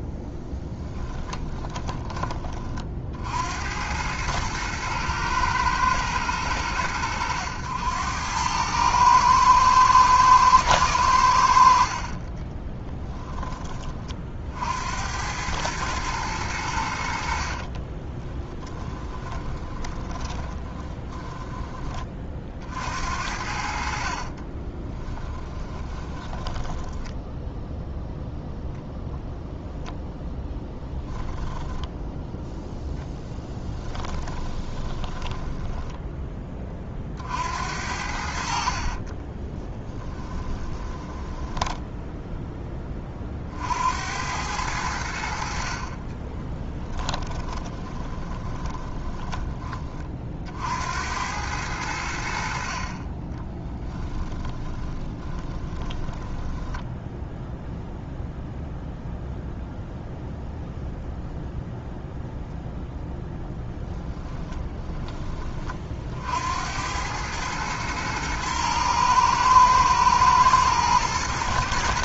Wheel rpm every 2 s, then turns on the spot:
10, 40, 110, 90, 110, 100, 10, 70, 80, 20, 10, 60, 20, 10, 0, 0, 10, 20, 40, 40, 20, 20, 90, 10, 10, 70, 40, 20, 10, 0, 0, 10, 20, 80, 110, 110.
0-2 12-14 18-22 24-28 34-36 38-42 46-50 54-58